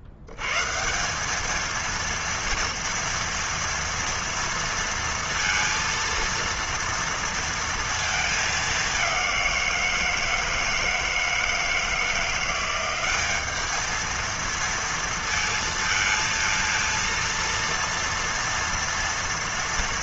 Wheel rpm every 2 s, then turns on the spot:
70, 230, 230, 230, 220, 160, 170, 230, 230, 230.
none